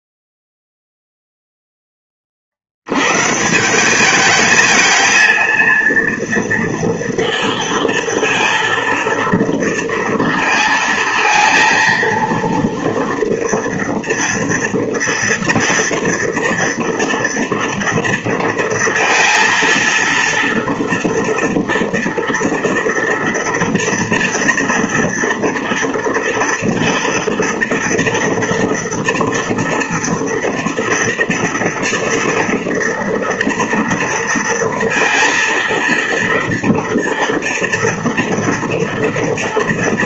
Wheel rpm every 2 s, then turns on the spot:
0, 70, 220, 230, 230, 230, 230, 230, 230, 230, 230, 230, 230, 230, 230, 230, 230, 230, 230, 230.
none